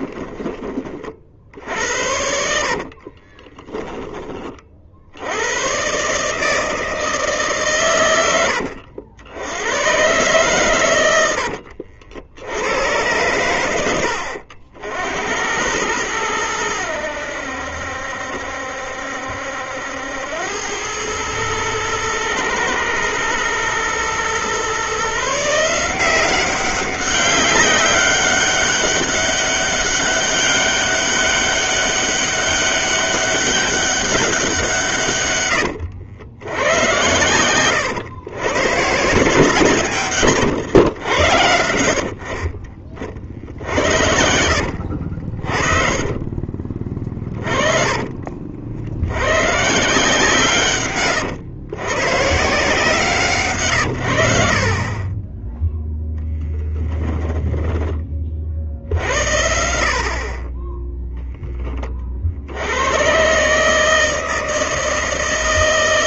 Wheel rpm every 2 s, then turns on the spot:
30, 50, 50, 160, 80, 100, 100, 70, 90, 70, 100, 120, 140, 190, 200, 200, 200, 150, 100, 150, 100, 70, 70, 40, 80, 130, 160, 30, 10, 60, 0, 100, 160.
2-4 46-48 56-58